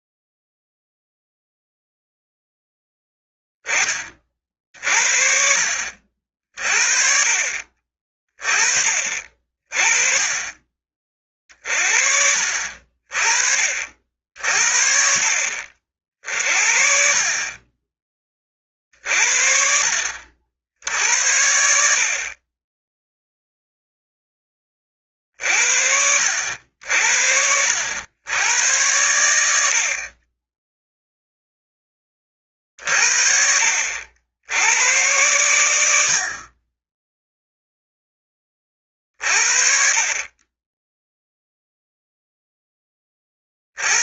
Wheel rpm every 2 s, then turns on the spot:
0, 0, 50, 50, 30, 30, 50, 60, 50, 30, 60, 30, 20, 80, 100, 20, 40, 80, 30, 20, 20, 10.
none